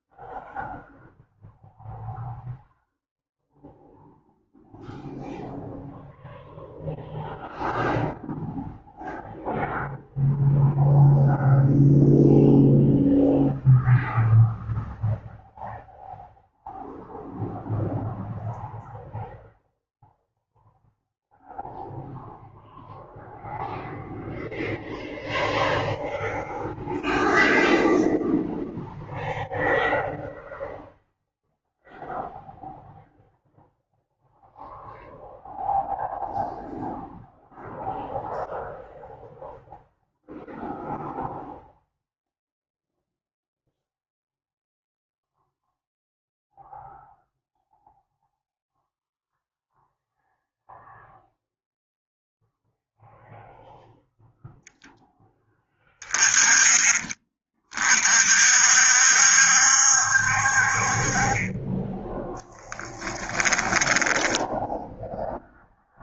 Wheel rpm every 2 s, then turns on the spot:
0, 0, 0, 0, 0, 0, 0, 0, 0, 0, 0, 0, 0, 0, 0, 0, 0, 0, 0, 0, 0, 0, 0, 0, 0, 0, 0, 10, 30, 60, 40, 10, 0.
62-64